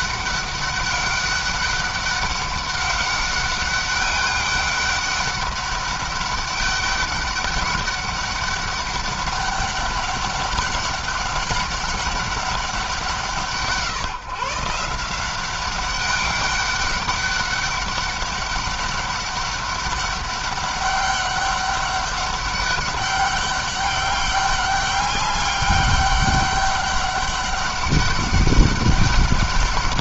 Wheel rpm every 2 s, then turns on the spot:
200, 200, 200, 200, 200, 200, 190, 160, 200, 200, 200, 200, 200, 200, 200.
none